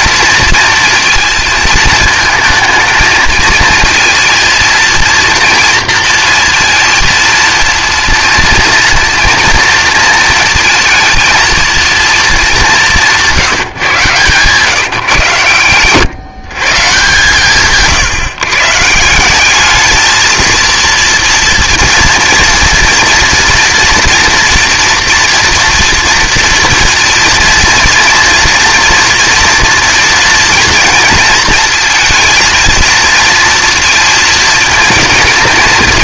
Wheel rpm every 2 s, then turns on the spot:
230, 230, 230, 230, 230, 220, 210, 140, 140, 140, 230, 230, 240, 230, 230, 230, 220, 220.
none